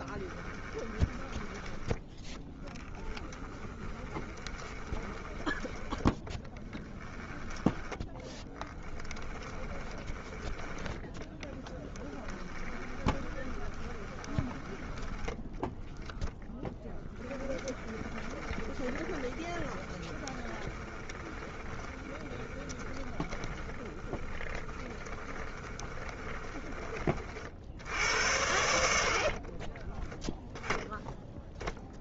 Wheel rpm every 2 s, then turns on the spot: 10, 10, 20, 20, 10, 10, 20, 10, 10, 20, 20, 20, 20, 20, 80, 0.
0-10 12-26 28-30